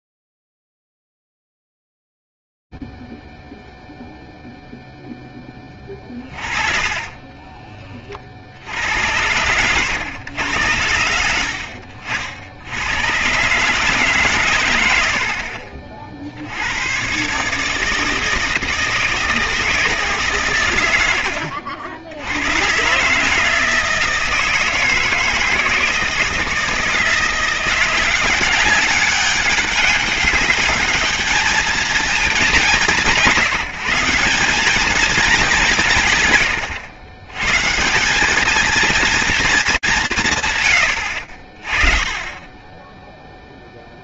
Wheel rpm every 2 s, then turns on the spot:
0, 0, 0, 30, 60, 100, 70, 130, 80, 160, 130, 100, 160, 160, 190, 200, 200, 190, 120, 210, 150, 10.
6-8